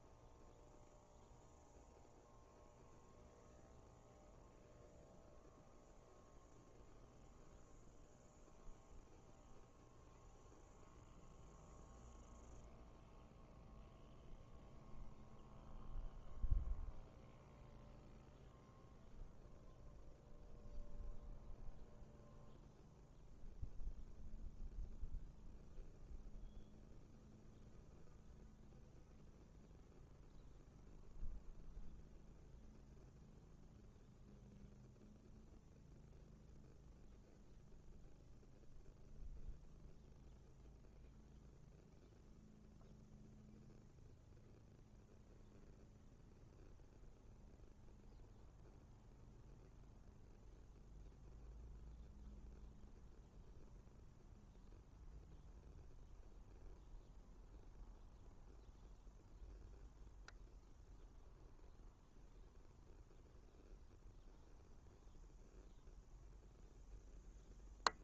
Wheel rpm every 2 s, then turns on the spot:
0, 0, 0, 0, 0, 0, 0, 0, 0, 0, 0, 0, 0, 0, 0, 0, 0, 0, 0, 0, 0, 0, 0, 0, 0, 0, 0, 0, 0, 0, 0, 0, 0, 0.
none